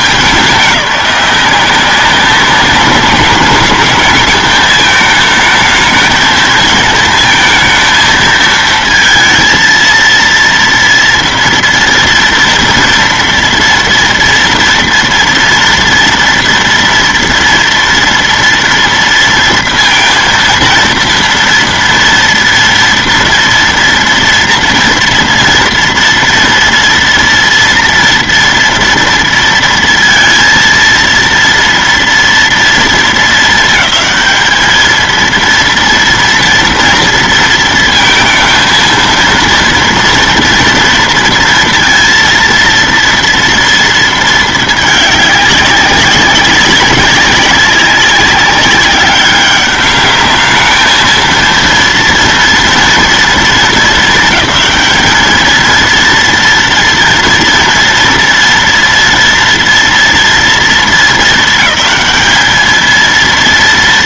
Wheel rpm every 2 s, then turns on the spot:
190, 190, 220, 220, 230, 230, 230, 230, 230, 230, 230, 230, 230, 230, 230, 230, 230, 220, 230, 230, 230, 230, 220, 200, 200, 220, 230, 210, 240, 230, 230, 220.
none